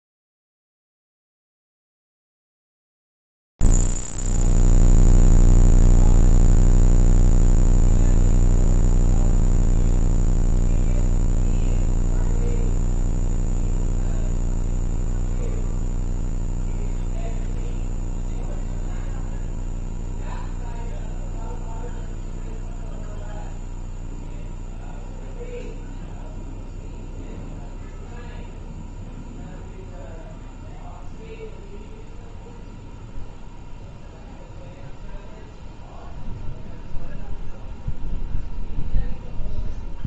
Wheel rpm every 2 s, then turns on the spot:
0, 0, 0, 0, 0, 0, 0, 0, 0, 0, 0, 0, 0, 0, 0, 0, 0, 0, 0, 0.
none